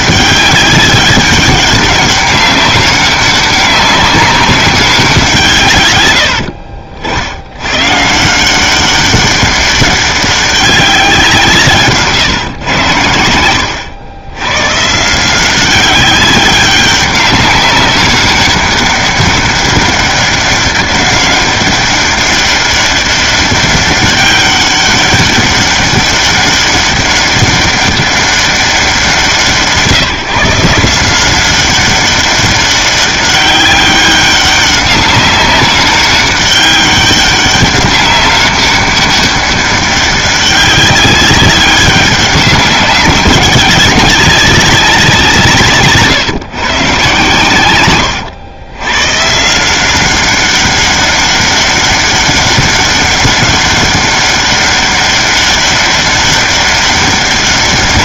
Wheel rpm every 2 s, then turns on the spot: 200, 200, 190, 70, 180, 200, 130, 110, 200, 200, 200, 200, 200, 200, 200, 160, 200, 200, 200, 200, 200, 200, 200, 140, 110, 200, 200, 200, 200.
none